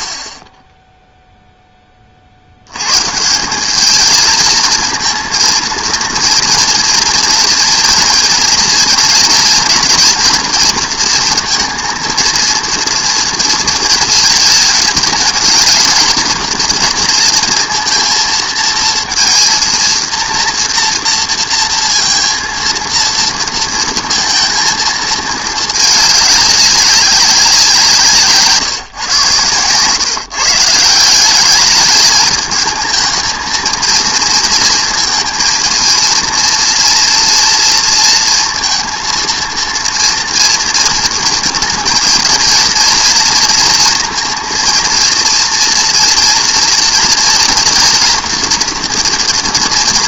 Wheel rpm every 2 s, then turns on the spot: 10, 90, 220, 230, 230, 230, 230, 220, 230, 230, 230, 230, 230, 200, 160, 160, 220, 230, 230, 230, 230, 230, 230, 230, 240.
none